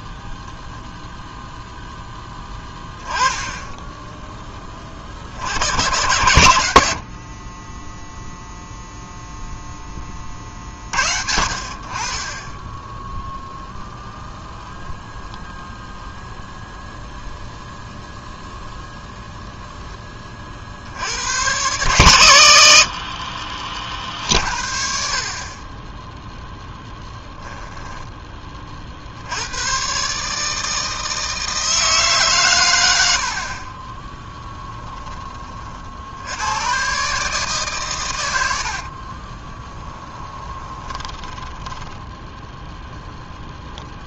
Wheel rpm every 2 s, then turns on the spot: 0, 10, 30, 90, 0, 50, 10, 0, 0, 0, 60, 70, 50, 10, 50, 160, 100, 10, 110, 60, 20, 0.
26-28 34-36 38-42